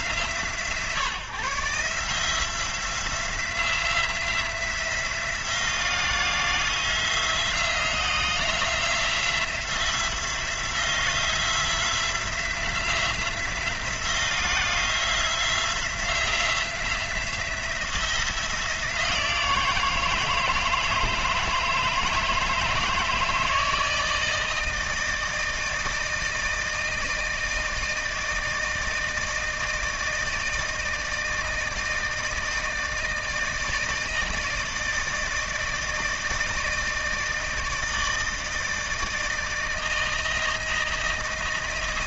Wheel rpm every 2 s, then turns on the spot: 130, 170, 180, 170, 180, 180, 180, 170, 170, 170, 160, 160, 160, 160, 160, 160, 160, 160, 160, 160, 160.
none